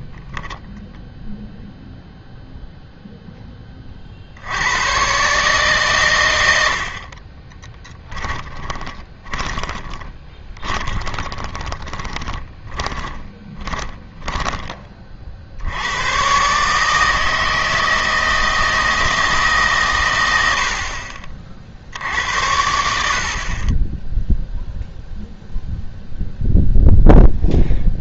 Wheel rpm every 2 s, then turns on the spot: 0, 0, 90, 70, 20, 20, 20, 20, 150, 160, 70, 70, 0, 0.
8-14